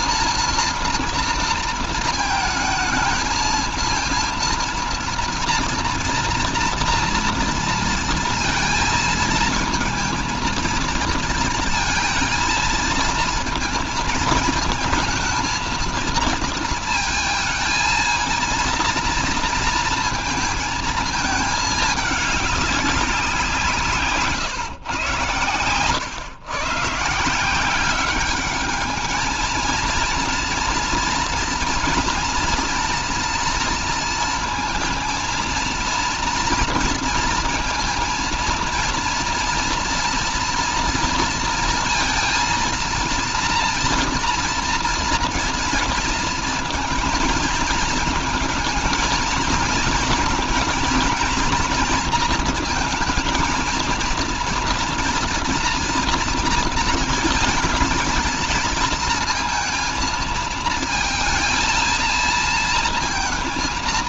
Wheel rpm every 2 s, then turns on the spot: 230, 220, 230, 240, 230, 230, 230, 220, 220, 230, 220, 190, 120, 140, 210, 230, 240, 230, 230, 230, 230, 230, 240, 230, 220, 230, 230, 230, 230, 230, 220, 230.
none